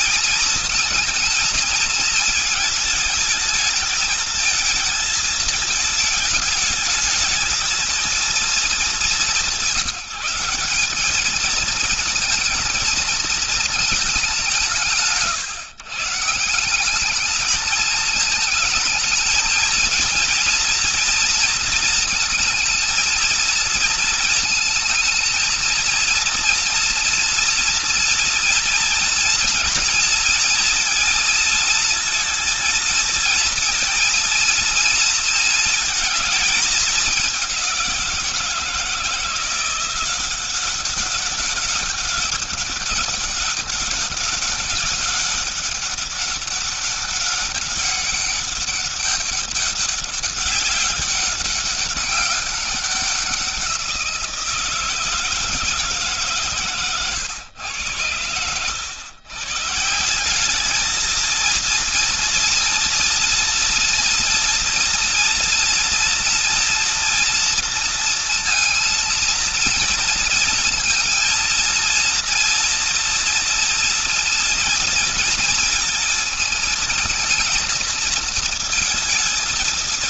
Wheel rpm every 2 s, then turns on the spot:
230, 220, 220, 210, 210, 210, 220, 160, 190, 230, 230, 230, 220, 230, 230, 230, 230, 230, 210, 170, 190, 200, 200, 200, 200, 200, 190, 160, 130, 120, 220, 230, 240, 240, 230, 230, 230, 230, 220, 230.
none